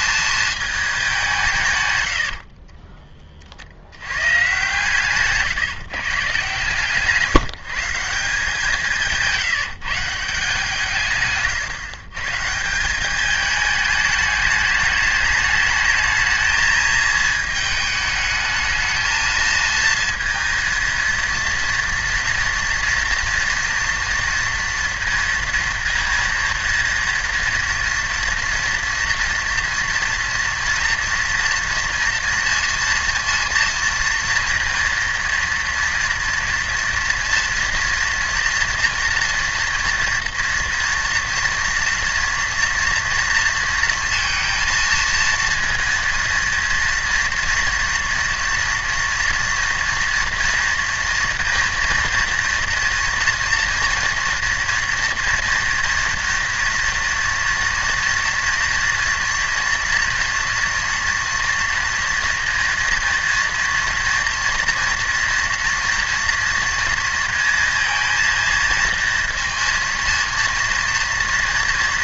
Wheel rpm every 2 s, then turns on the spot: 220, 40, 120, 140, 180, 160, 170, 210, 220, 220, 230, 230, 230, 230, 230, 240, 230, 230, 230, 230, 240, 230, 230, 230, 230, 230, 230, 230, 230, 230, 230, 230, 240, 230, 230, 230.
2-4